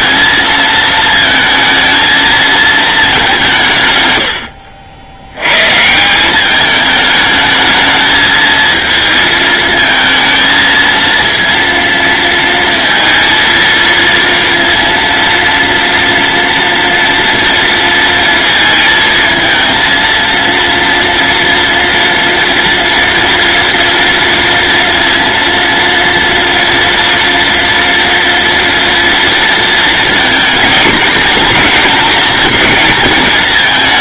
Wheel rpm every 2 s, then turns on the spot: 220, 220, 80, 210, 220, 230, 230, 230, 230, 230, 230, 230, 230, 230, 230, 230, 220.
none